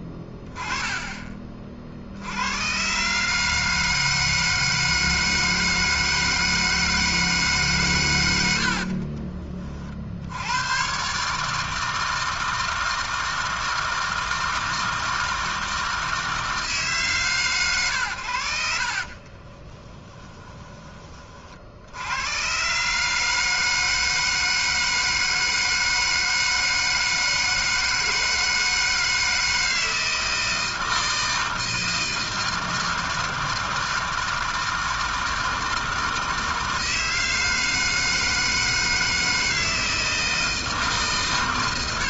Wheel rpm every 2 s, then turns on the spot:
10, 130, 160, 160, 70, 110, 160, 160, 150, 70, 20, 140, 160, 160, 160, 160, 160, 160, 160, 160, 160.
20-22